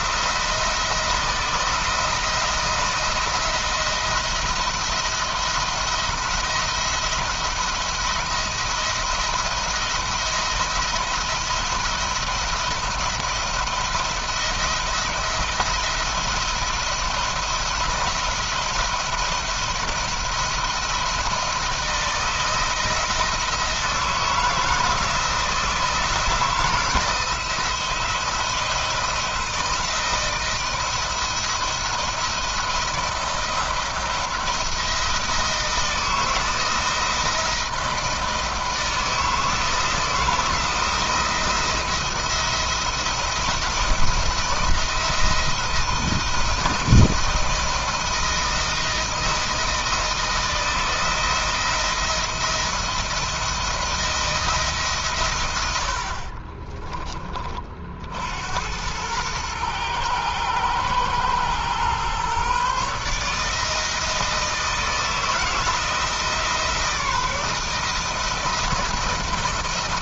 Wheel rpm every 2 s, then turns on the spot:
170, 170, 170, 170, 170, 170, 170, 170, 170, 170, 160, 160, 160, 160, 170, 160, 170, 170, 170, 160, 160, 170, 160, 160, 160, 170, 170, 130, 30, 100, 110, 150, 160, 160, 170.
none